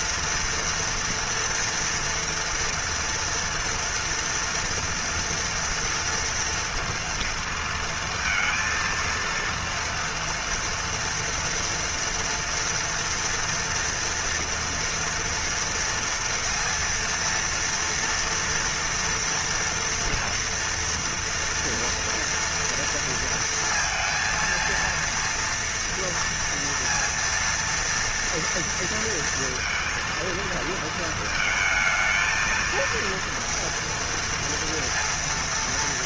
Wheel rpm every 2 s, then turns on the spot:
230, 230, 230, 230, 230, 240, 230, 230, 230, 230, 230, 230, 230, 230, 230, 230, 230, 230.
none